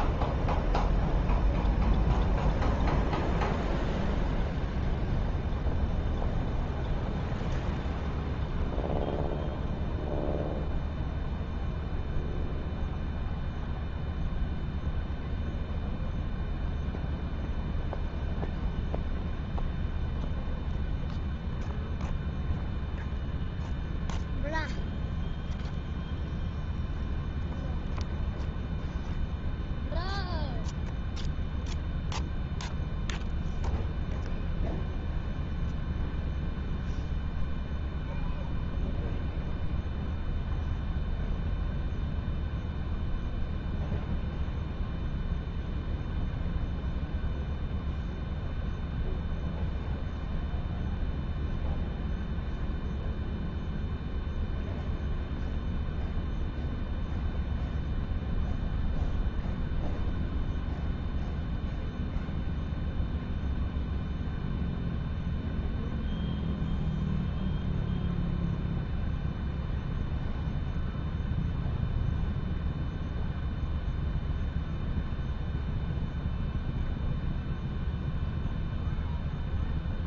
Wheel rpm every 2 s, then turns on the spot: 0, 0, 0, 0, 0, 0, 0, 0, 0, 0, 0, 0, 0, 0, 0, 0, 0, 0, 0, 0, 0, 0, 0, 0, 0, 0, 0, 0, 0, 0, 0, 0, 0, 0, 0, 0, 0, 0, 0, 0.
none